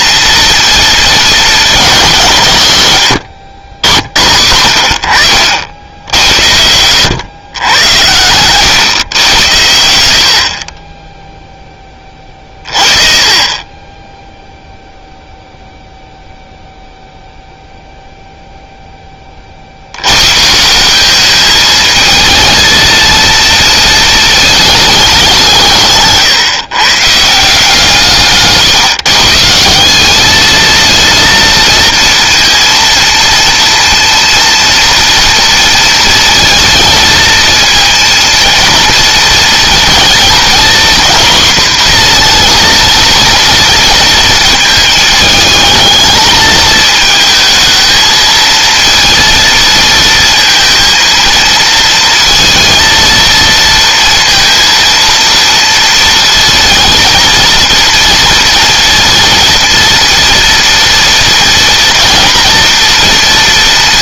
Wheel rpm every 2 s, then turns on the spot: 230, 100, 90, 100, 110, 20, 20, 0, 0, 10, 190, 230, 210, 140, 140, 230, 230, 230, 230, 230, 240, 230, 220, 220, 230, 230, 230, 230, 230, 230, 230, 230.
none